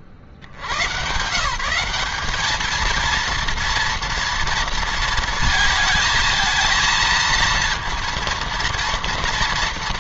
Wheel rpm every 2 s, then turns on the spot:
90, 220, 230, 230, 230.
none